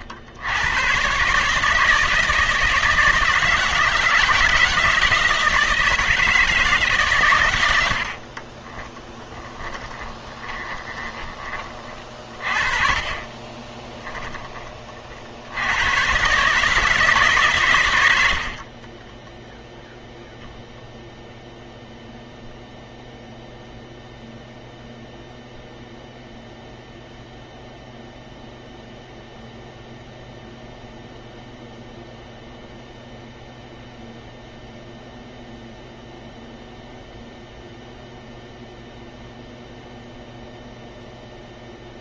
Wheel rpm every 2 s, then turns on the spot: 110, 170, 160, 150, 20, 20, 40, 30, 150, 40, 0, 0, 0, 0, 0, 0, 0, 0, 0, 0, 0.
8-14 18-20